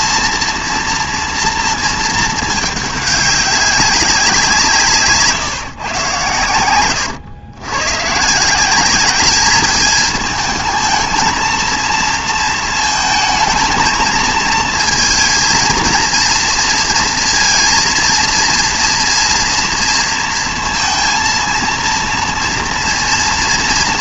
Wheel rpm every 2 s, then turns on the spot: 230, 220, 170, 110, 170, 220, 230, 230, 240, 230, 230, 230.
none